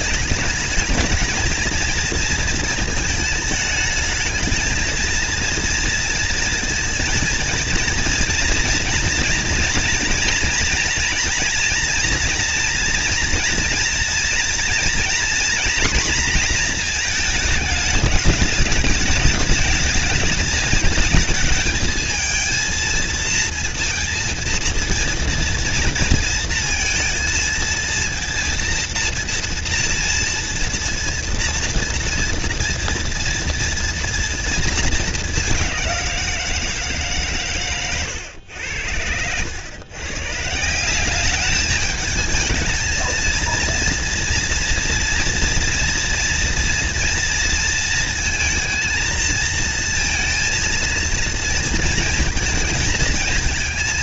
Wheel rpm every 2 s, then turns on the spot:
210, 230, 220, 230, 230, 230, 230, 230, 230, 210, 220, 230, 230, 230, 230, 230, 230, 230, 170, 100, 150, 220, 230, 240, 230, 230, 220.
none